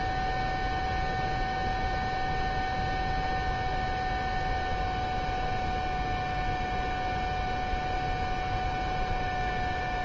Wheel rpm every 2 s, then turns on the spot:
0, 0, 0, 0, 0.
none